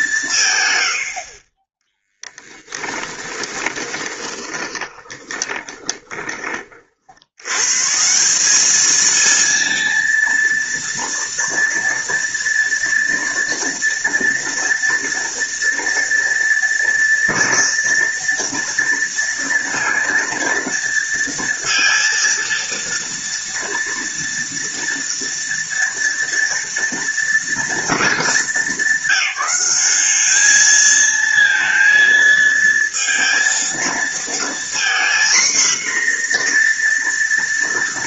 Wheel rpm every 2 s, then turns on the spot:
120, 30, 20, 40, 210, 240, 240, 230, 230, 230, 230, 230, 230, 230, 200, 220, 230, 240, 240.
2-6